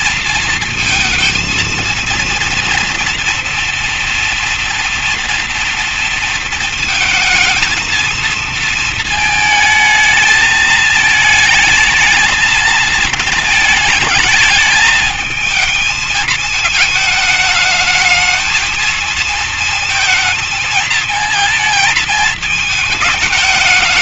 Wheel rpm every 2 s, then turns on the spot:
230, 230, 230, 220, 220, 220, 220, 220, 220, 230, 230, 220.
none